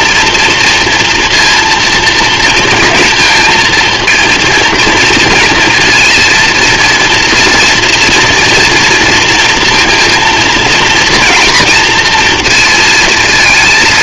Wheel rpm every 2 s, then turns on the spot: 240, 230, 230, 230, 230, 230, 230.
none